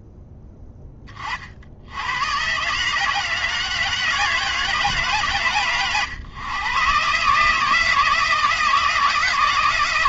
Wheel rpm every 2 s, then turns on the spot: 50, 150, 140, 140, 160.
none